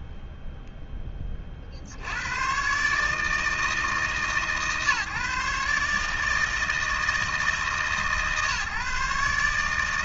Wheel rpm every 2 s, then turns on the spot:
10, 140, 150, 160, 150.
none